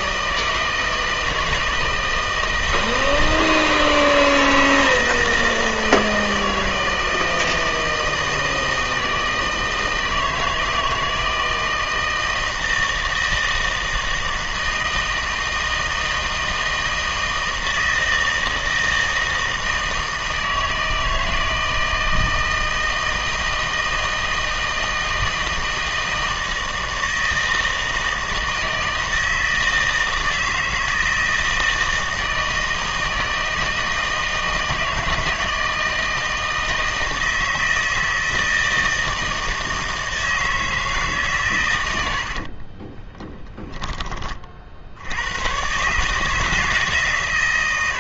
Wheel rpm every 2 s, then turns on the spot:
160, 160, 160, 160, 160, 160, 160, 160, 160, 160, 160, 160, 160, 160, 160, 160, 160, 160, 160, 160, 160, 40, 60, 160.
42-44